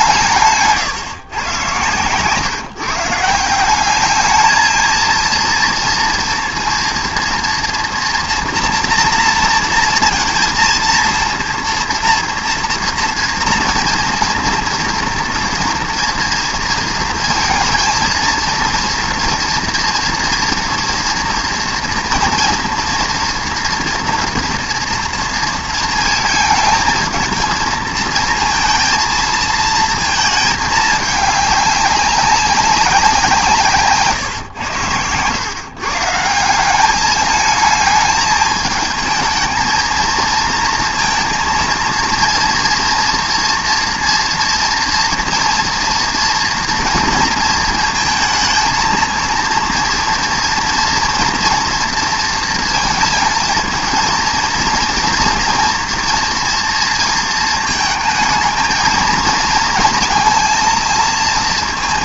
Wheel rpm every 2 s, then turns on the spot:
160, 150, 220, 230, 230, 230, 230, 230, 230, 230, 230, 240, 230, 220, 230, 210, 200, 110, 180, 220, 230, 230, 230, 240, 220, 230, 230, 230, 230, 220, 230.
none